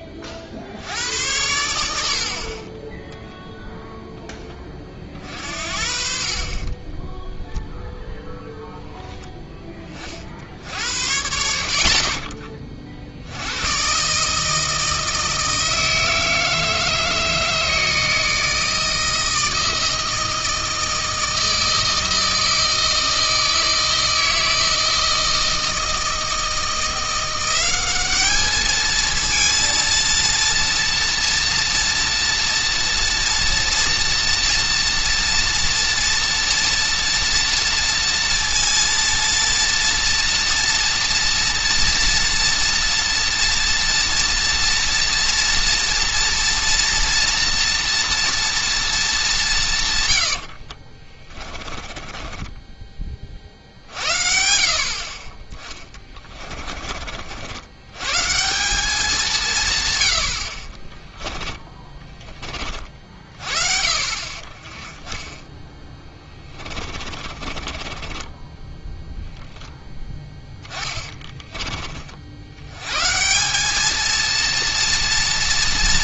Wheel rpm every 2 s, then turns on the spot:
60, 30, 20, 30, 0, 70, 40, 160, 160, 160, 160, 160, 160, 170, 220, 230, 230, 240, 240, 230, 240, 230, 230, 230, 230, 60, 20, 60, 30, 190, 30, 30, 40, 20, 10, 20, 100, 230.
6-8 50-54 56-58 60-62 66-72